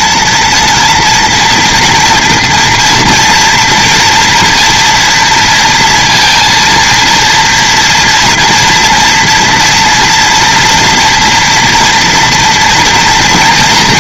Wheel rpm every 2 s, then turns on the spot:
230, 240, 230, 230, 230, 230, 230.
none